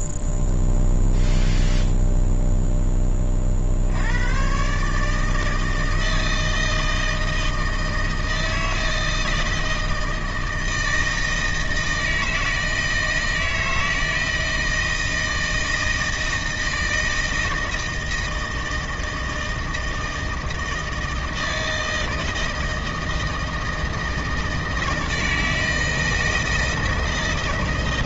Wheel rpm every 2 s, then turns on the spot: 0, 0, 130, 160, 160, 160, 160, 160, 160, 160, 160, 160, 160, 160.
none